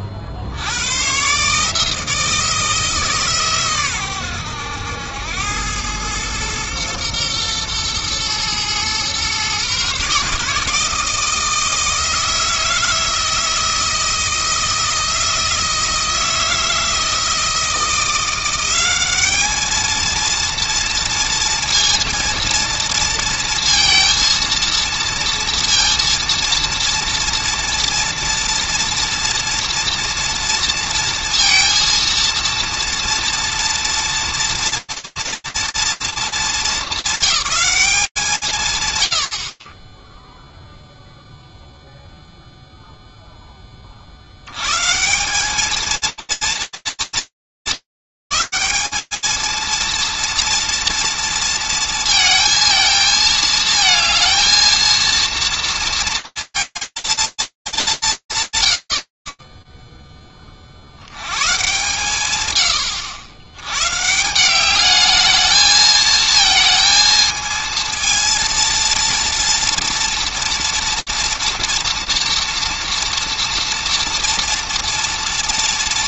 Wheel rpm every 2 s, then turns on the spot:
80, 160, 90, 110, 120, 150, 160, 160, 160, 190, 230, 230, 230, 230, 230, 230, 230, 240, 220, 140, 0, 0, 180, 240, 210, 240, 230, 220, 220, 150, 20, 130, 180, 220, 230, 230, 230, 230.
none